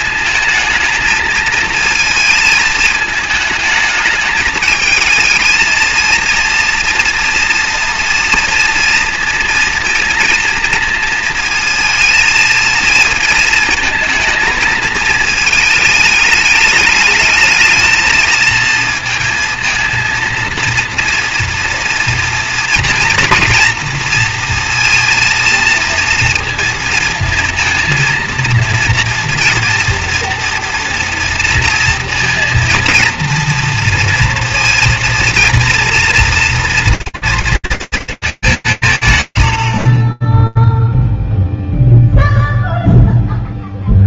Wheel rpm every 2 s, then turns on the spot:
220, 220, 220, 240, 230, 230, 220, 220, 210, 230, 230, 230, 230, 230, 230, 240, 230, 230, 240, 200, 10, 0.
none